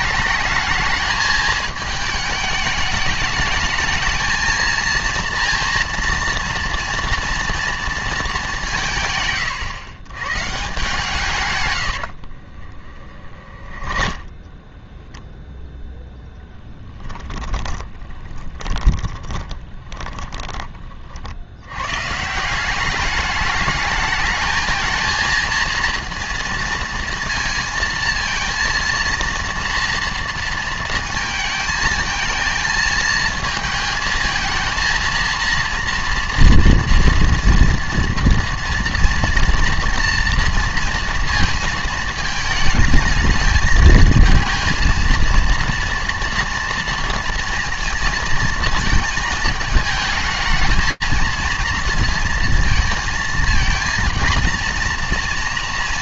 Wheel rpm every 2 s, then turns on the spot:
220, 210, 230, 230, 170, 140, 40, 10, 10, 20, 20, 190, 220, 230, 230, 220, 220, 230, 230, 230, 230, 220, 230, 230, 220, 220, 230, 230.
12-14 16-20